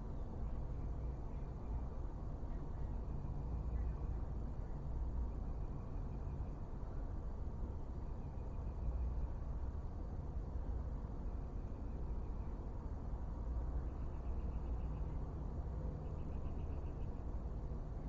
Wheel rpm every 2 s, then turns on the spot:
0, 0, 0, 0, 0, 0, 0, 0, 0.
none